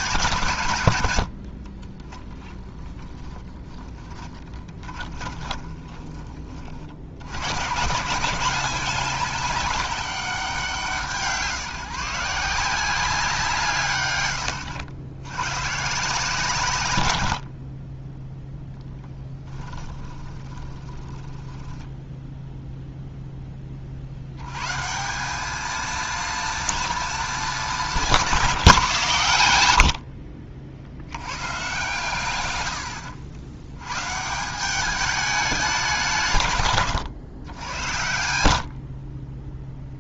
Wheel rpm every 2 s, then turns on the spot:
110, 20, 20, 60, 190, 160, 170, 80, 140, 0, 20, 0, 160, 230, 160, 70, 90, 190, 130, 60.
2-6 20-22 36-38